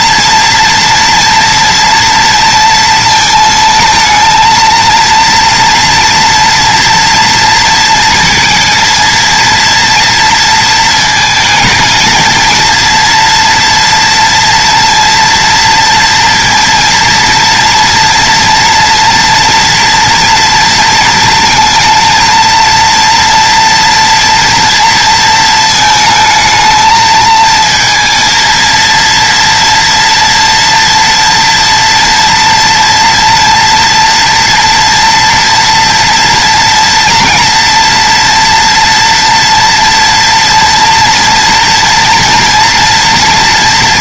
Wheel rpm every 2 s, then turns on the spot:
230, 230, 230, 240, 230, 230, 230, 230, 230, 230, 230, 230, 230, 220, 230, 240, 230, 230, 230, 230, 230, 230.
none